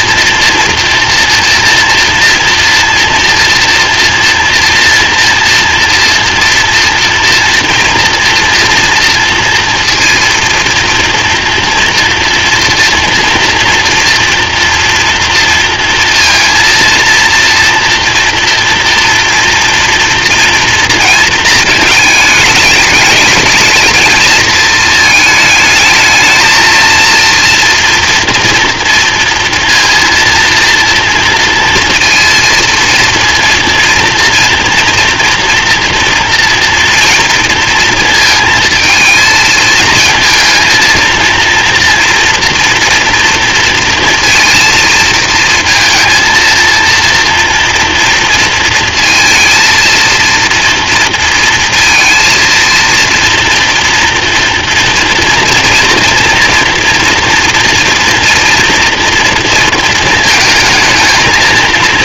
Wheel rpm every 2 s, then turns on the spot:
230, 230, 230, 230, 230, 230, 230, 230, 230, 230, 230, 210, 220, 220, 230, 230, 230, 230, 240, 230, 220, 240, 230, 230, 230, 230, 230, 230, 230, 230, 220.
none